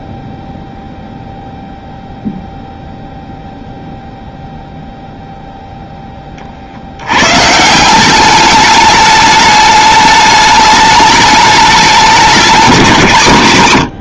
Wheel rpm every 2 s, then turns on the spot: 0, 0, 0, 60, 200, 210, 190.
none